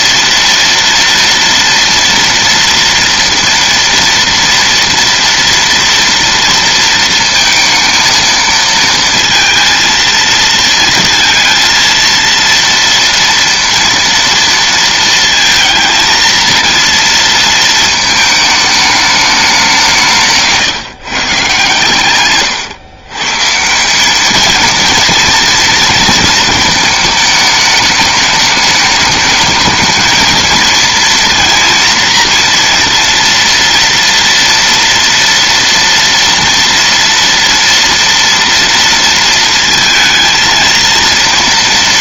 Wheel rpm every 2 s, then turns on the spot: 230, 230, 230, 230, 220, 230, 230, 230, 230, 210, 140, 130, 230, 220, 210, 230, 230, 230, 230, 230, 230.
none